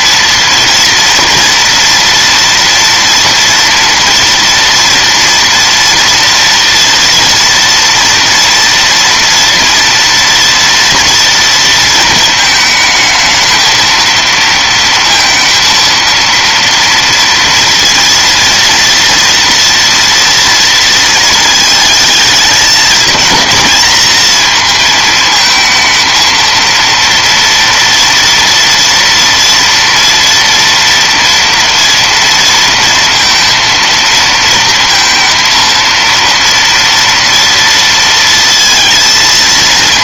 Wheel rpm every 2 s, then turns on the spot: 240, 230, 230, 230, 230, 230, 220, 230, 230, 230, 220, 230, 220, 230, 230, 230, 230, 230, 230, 230.
none